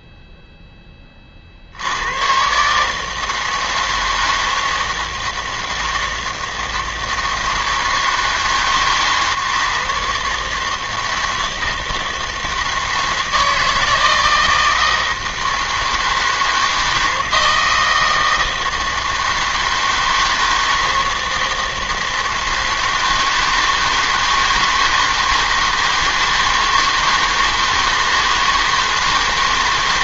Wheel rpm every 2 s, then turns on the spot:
10, 140, 160, 160, 140, 160, 160, 160, 160, 160, 160, 160, 160, 160, 160.
none